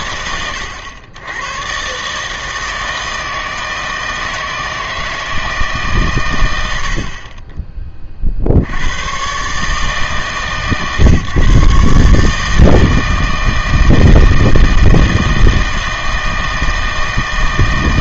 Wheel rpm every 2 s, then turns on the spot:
90, 160, 160, 90, 70, 140, 160, 160, 160.
none